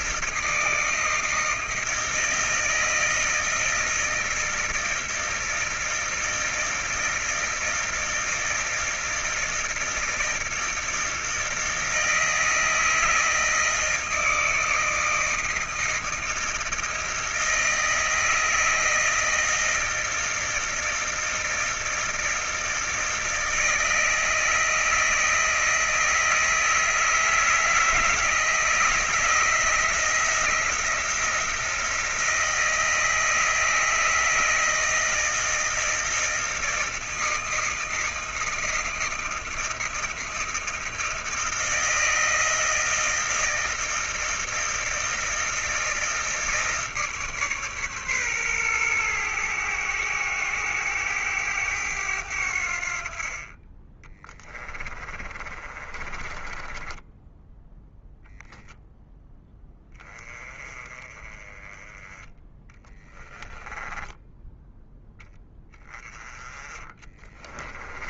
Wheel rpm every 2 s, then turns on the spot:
160, 160, 160, 160, 160, 160, 160, 160, 160, 160, 160, 160, 160, 160, 160, 160, 170, 160, 160, 160, 160, 160, 160, 160, 140, 100, 90, 30, 30, 10, 10, 20, 10, 10.
54-58 64-66